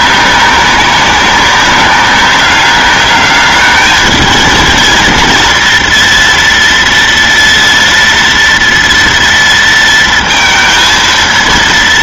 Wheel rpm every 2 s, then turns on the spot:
200, 210, 230, 230, 230, 230.
none